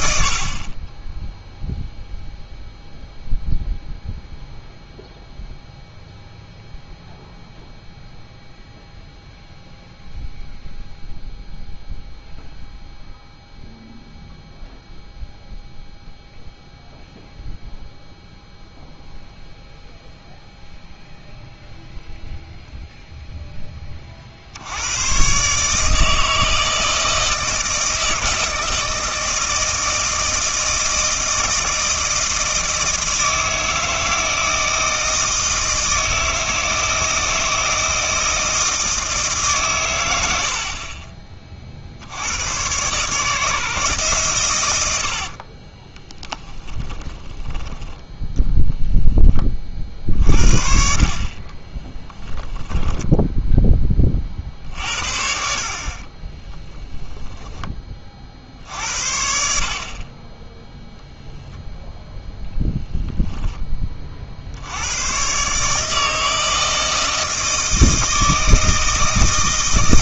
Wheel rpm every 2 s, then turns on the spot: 30, 0, 0, 0, 0, 0, 0, 0, 0, 0, 0, 0, 80, 160, 160, 160, 160, 160, 160, 160, 50, 130, 90, 20, 0, 50, 10, 60, 10, 70, 0, 0, 90, 160, 160.
40-42 46-48 56-58